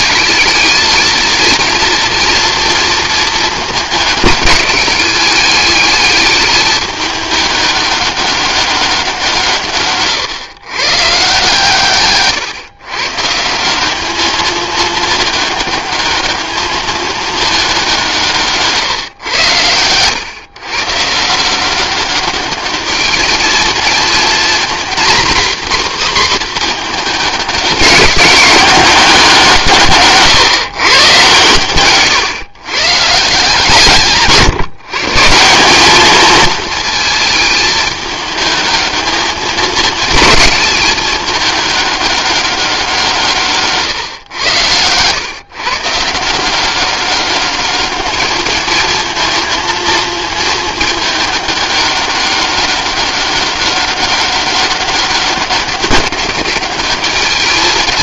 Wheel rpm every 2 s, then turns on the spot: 220, 230, 200, 210, 200, 130, 130, 220, 210, 150, 130, 200, 230, 230, 200, 130, 130, 150, 230, 220, 220, 190, 120, 190, 220, 220, 200, 200, 200.
44-46